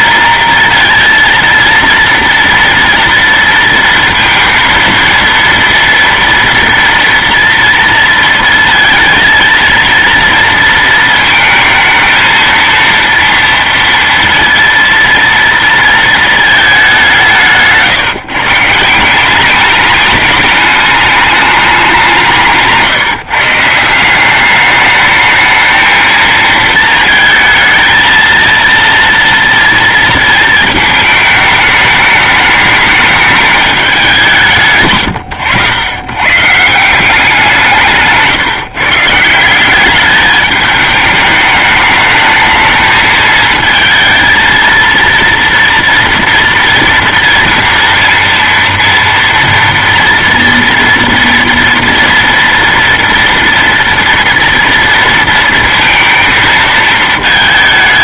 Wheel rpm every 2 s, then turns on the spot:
230, 230, 230, 230, 230, 230, 230, 230, 210, 140, 210, 160, 200, 230, 230, 220, 210, 150, 150, 150, 210, 220, 230, 230, 230, 230, 240, 230, 220.
none